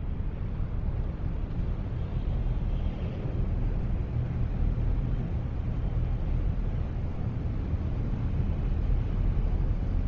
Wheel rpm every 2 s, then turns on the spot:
0, 0, 0, 0, 0.
none